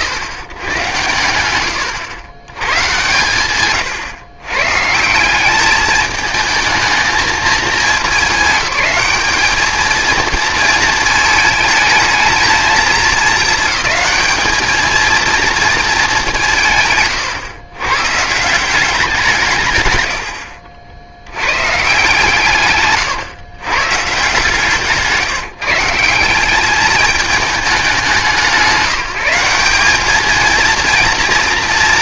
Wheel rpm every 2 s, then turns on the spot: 110, 120, 140, 220, 200, 230, 220, 220, 160, 170, 90, 150, 160, 200, 160, 230.
none